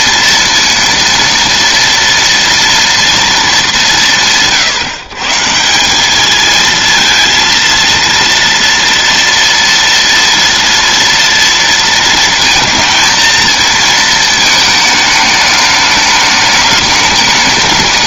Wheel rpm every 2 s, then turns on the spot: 230, 230, 140, 220, 230, 230, 230, 220, 210.
none